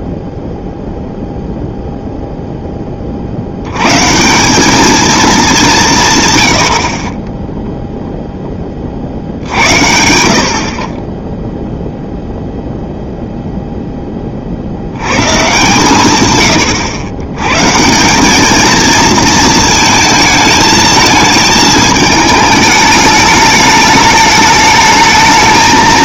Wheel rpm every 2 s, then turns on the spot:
0, 180, 90, 10, 60, 0, 30, 110, 190, 220, 210, 210, 230.
none